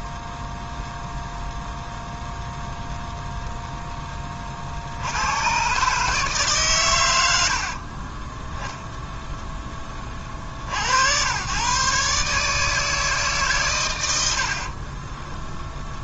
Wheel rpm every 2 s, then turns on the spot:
0, 0, 80, 110, 10, 80, 160, 30.
14-16